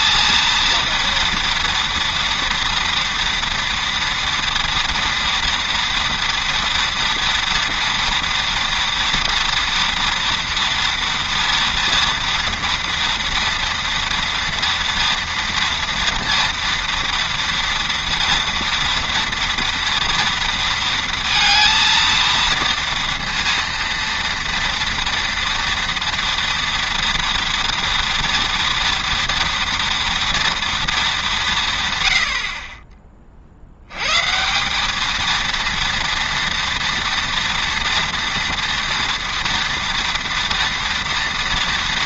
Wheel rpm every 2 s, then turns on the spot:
230, 230, 230, 230, 230, 230, 230, 230, 230, 230, 230, 230, 230, 230, 230, 230, 50, 190, 230, 230, 230.
none